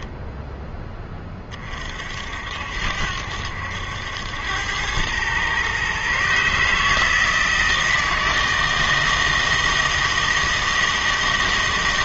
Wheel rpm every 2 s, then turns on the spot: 10, 70, 100, 150, 160, 160.
none